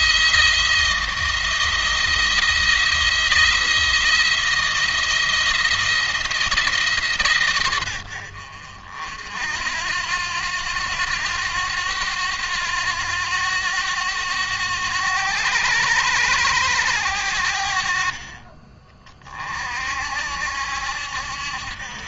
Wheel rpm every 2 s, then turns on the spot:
170, 170, 170, 150, 60, 90, 90, 90, 80, 30, 70.
none